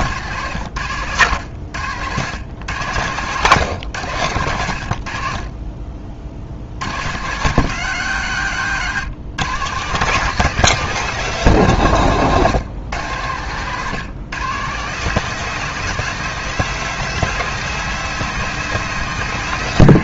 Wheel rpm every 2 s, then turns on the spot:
130, 120, 90, 90, 130, 190, 130, 170, 200, 190.
none